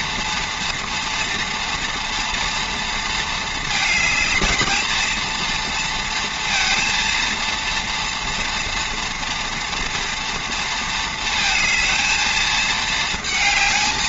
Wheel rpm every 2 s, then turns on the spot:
230, 230, 220, 230, 230, 230, 220.
none